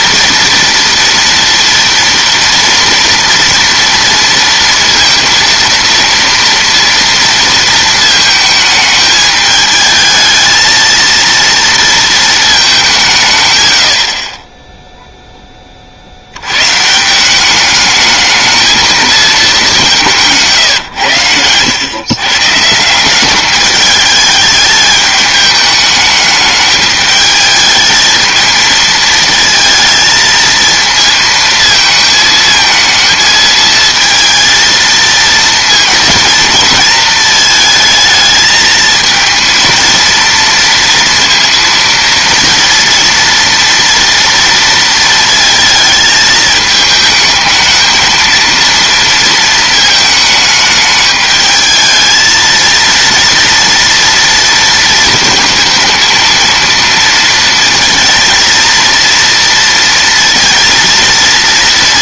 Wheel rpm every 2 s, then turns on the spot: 230, 230, 230, 230, 220, 220, 220, 20, 120, 220, 150, 160, 210, 210, 220, 230, 220, 220, 230, 220, 230, 230, 230, 220, 230, 220, 230, 230, 230, 230, 230.
none